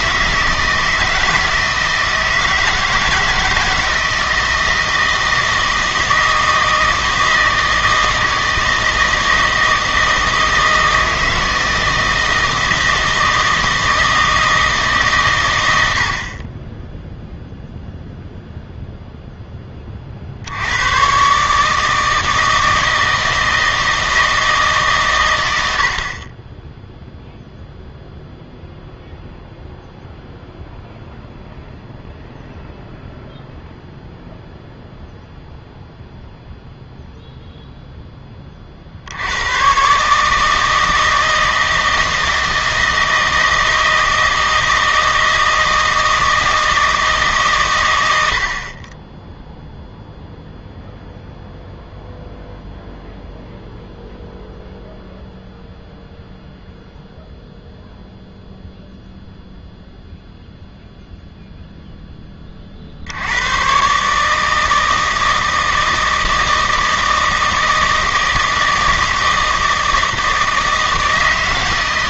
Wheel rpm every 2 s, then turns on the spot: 160, 160, 160, 160, 160, 160, 160, 160, 20, 0, 90, 160, 150, 10, 0, 0, 0, 0, 0, 50, 160, 160, 160, 160, 50, 0, 0, 0, 0, 0, 0, 40, 160, 160, 160, 160.
none